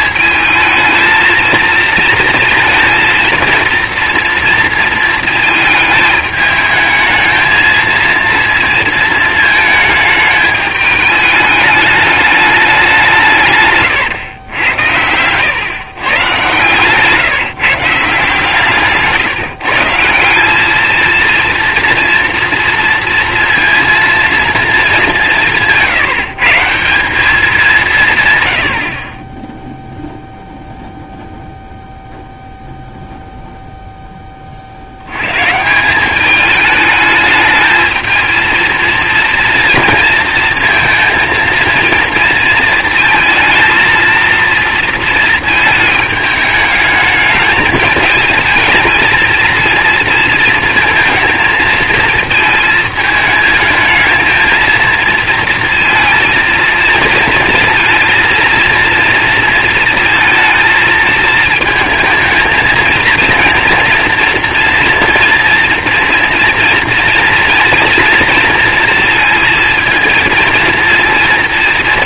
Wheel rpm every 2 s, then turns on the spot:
220, 230, 230, 220, 220, 210, 160, 100, 150, 150, 230, 230, 190, 190, 30, 0, 0, 110, 220, 230, 230, 220, 220, 210, 230, 220, 220, 230, 230, 230, 220, 230, 230, 240, 230, 230.
none